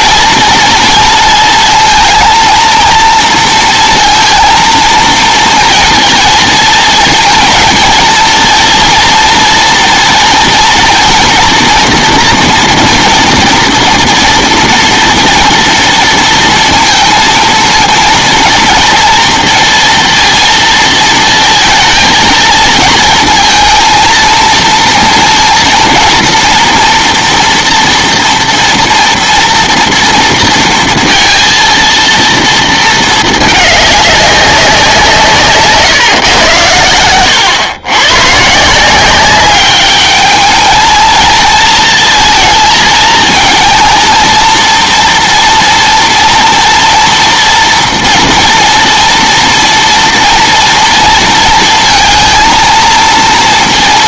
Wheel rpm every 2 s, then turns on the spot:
230, 230, 230, 220, 230, 230, 240, 230, 230, 230, 230, 230, 230, 230, 230, 230, 220, 180, 110, 170, 220, 220, 230, 230, 230, 230, 230.
none